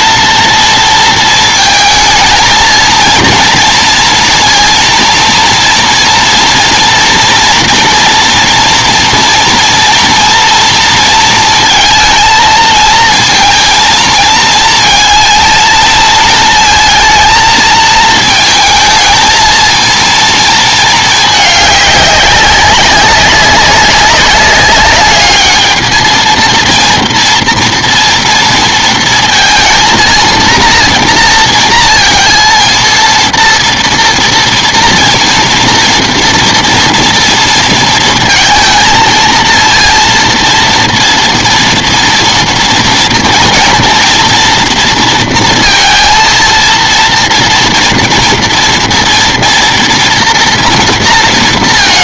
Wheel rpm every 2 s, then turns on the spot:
230, 230, 230, 230, 230, 230, 220, 230, 230, 220, 220, 200, 200, 230, 230, 230, 230, 230, 230, 230, 240, 230, 230, 230, 230, 230.
none